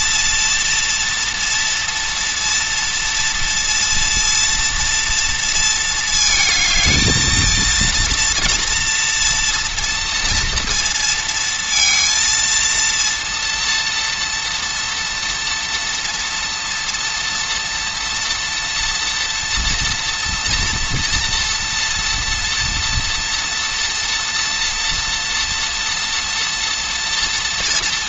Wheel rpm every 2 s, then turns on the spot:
230, 230, 230, 220, 230, 230, 230, 230, 230, 240, 230, 230, 230, 230.
none